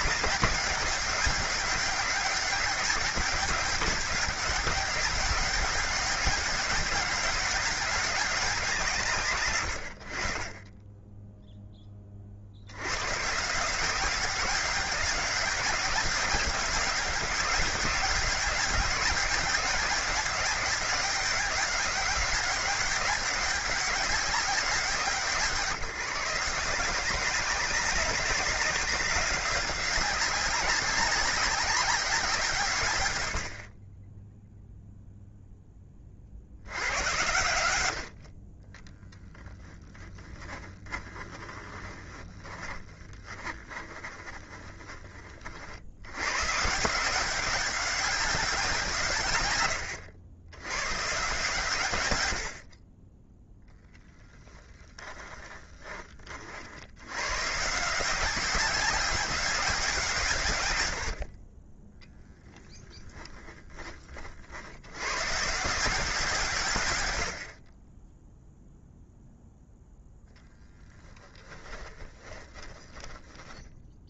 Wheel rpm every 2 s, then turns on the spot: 200, 190, 200, 200, 130, 10, 100, 190, 190, 200, 200, 200, 160, 180, 190, 190, 130, 0, 90, 20, 20, 20, 20, 170, 170, 130, 30, 10, 80, 190, 100, 10, 70, 130, 0, 10, 10.
38-44 54-56 62-64 70-74